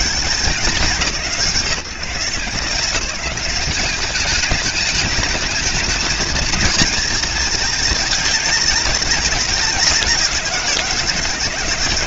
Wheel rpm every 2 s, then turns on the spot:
160, 160, 200, 220, 210, 170.
none